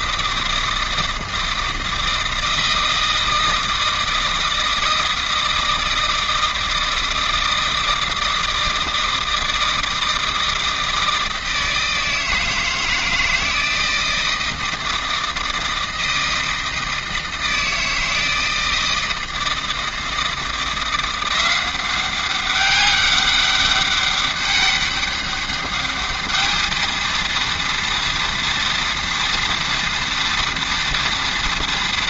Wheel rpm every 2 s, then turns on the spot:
160, 160, 160, 160, 160, 160, 160, 160, 160, 160, 170, 190, 200, 220, 230, 240.
none